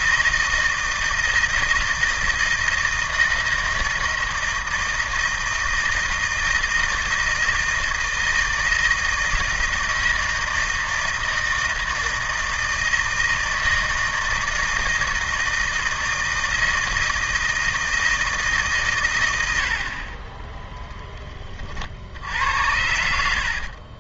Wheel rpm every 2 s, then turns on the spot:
160, 160, 170, 160, 160, 160, 160, 160, 160, 140, 10, 80.
none